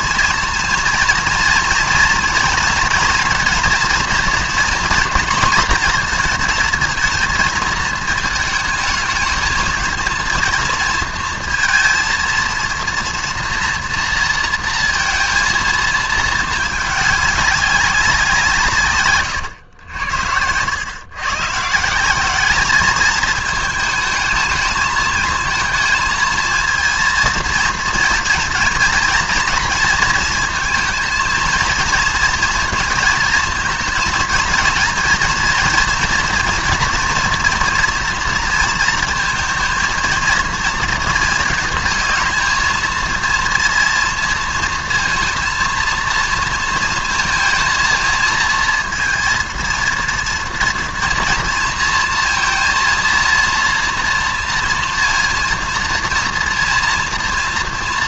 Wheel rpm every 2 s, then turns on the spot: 230, 230, 240, 230, 220, 230, 230, 230, 210, 150, 110, 210, 220, 230, 230, 230, 230, 230, 230, 230, 230, 230, 220, 230, 230, 230, 230, 230, 230.
none